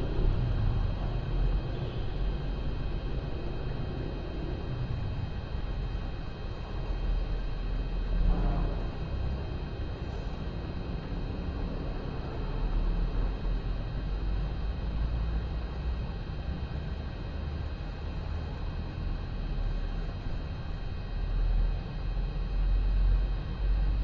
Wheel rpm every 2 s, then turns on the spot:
0, 0, 0, 0, 0, 0, 0, 0, 0, 0, 0, 0.
none